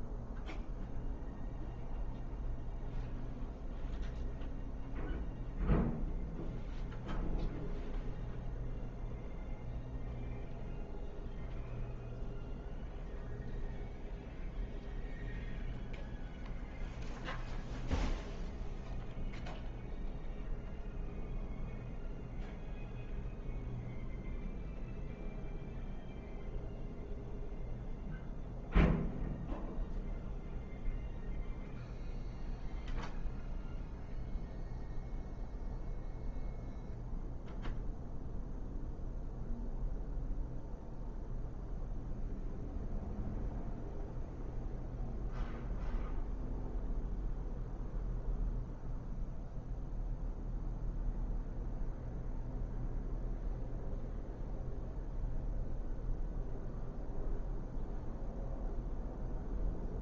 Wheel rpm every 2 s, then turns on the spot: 0, 0, 0, 0, 0, 0, 0, 0, 0, 0, 0, 0, 0, 0, 0, 0, 0, 0, 0, 0, 0, 0, 0, 0, 0, 0, 0, 0, 0, 0.
none